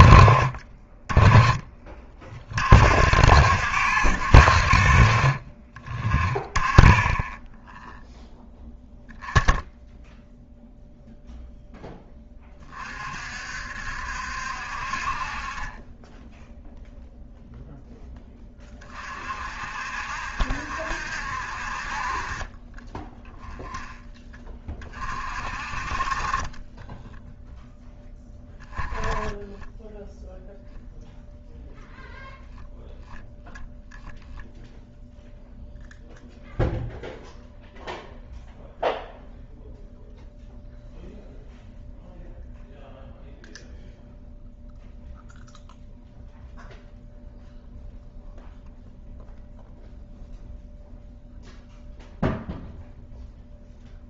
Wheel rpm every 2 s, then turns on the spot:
20, 50, 50, 10, 0, 0, 30, 60, 0, 30, 70, 20, 20, 10, 10, 0, 0, 0, 0, 0, 0, 0, 0, 0, 0, 0, 0.
22-24